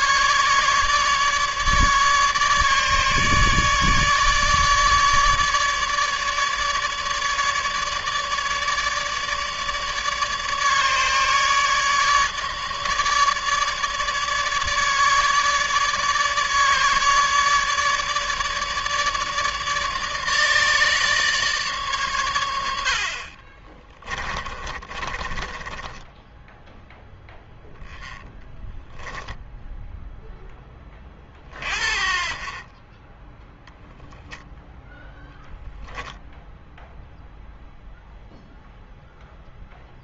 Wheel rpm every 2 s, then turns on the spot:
150, 150, 150, 150, 150, 150, 150, 150, 150, 150, 150, 90, 20, 0, 10, 20, 30, 10, 0, 0.
24-26 28-30 34-36